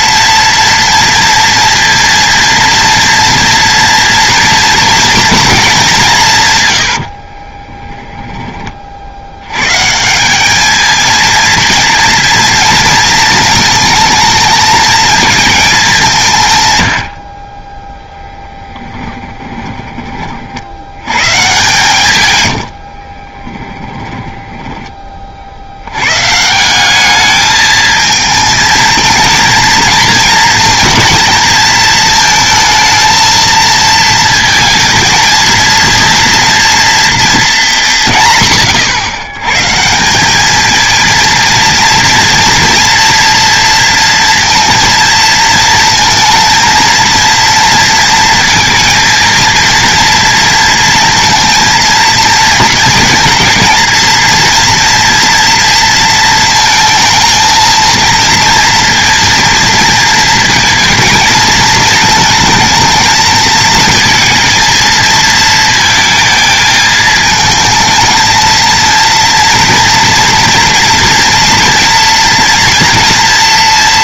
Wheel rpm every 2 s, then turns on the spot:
230, 230, 230, 110, 30, 210, 230, 220, 120, 10, 80, 80, 20, 180, 220, 230, 220, 230, 230, 130, 220, 230, 230, 230, 230, 230, 230, 230, 230, 230, 230, 230, 230, 220, 230, 240, 230.
18-20 22-26